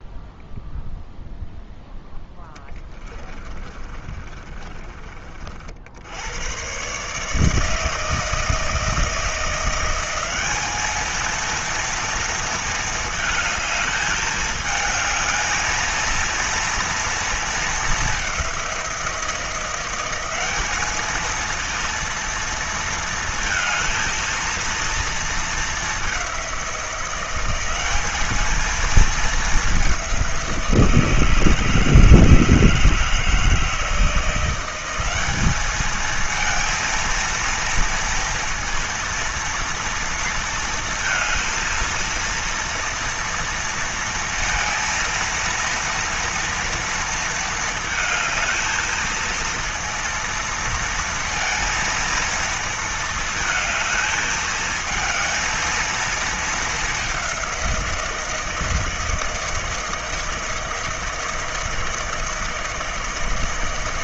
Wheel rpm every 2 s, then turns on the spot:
0, 20, 30, 120, 160, 200, 230, 210, 230, 190, 200, 230, 230, 180, 220, 180, 160, 180, 230, 230, 230, 230, 230, 230, 220, 230, 230, 220, 210, 160, 160, 160.
2-6